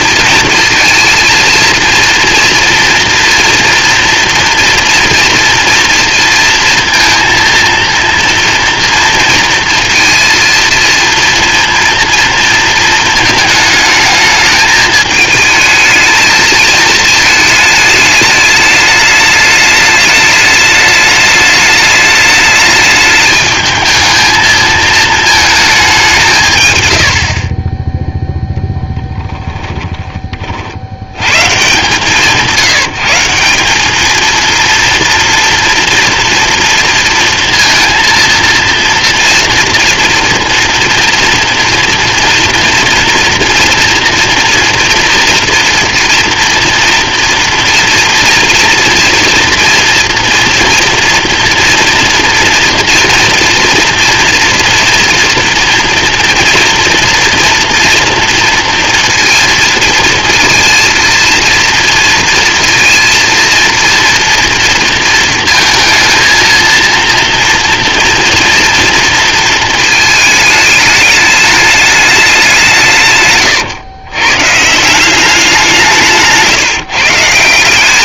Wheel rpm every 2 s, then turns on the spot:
230, 230, 230, 230, 230, 230, 230, 220, 220, 210, 210, 210, 220, 110, 0, 50, 160, 230, 230, 230, 230, 230, 240, 230, 230, 230, 230, 230, 230, 230, 230, 230, 230, 230, 230, 210, 170, 150, 150.
26-28